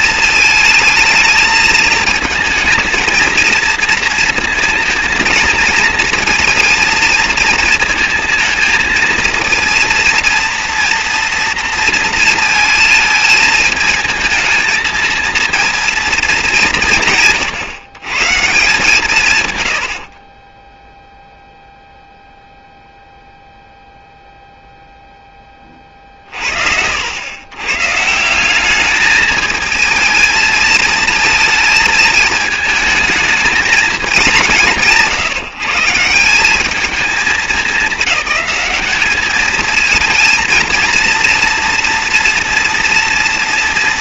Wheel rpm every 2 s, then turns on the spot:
220, 220, 230, 230, 230, 230, 230, 220, 190, 160, 20, 0, 0, 60, 200, 220, 220, 190, 190, 200, 230, 230.
20-22